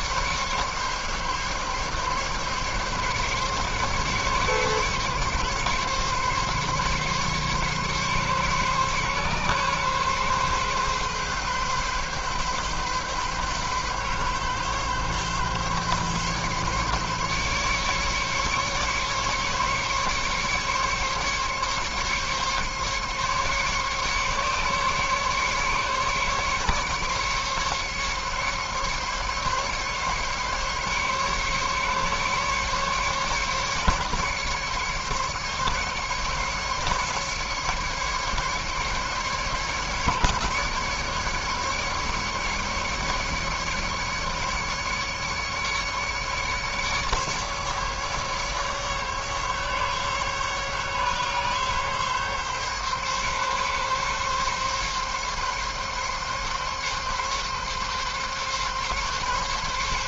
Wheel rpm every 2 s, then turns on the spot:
140, 140, 140, 140, 140, 140, 140, 140, 140, 140, 140, 140, 140, 140, 140, 140, 140, 140, 140, 150, 150, 150, 150, 150, 140, 140, 140, 140, 140, 140.
none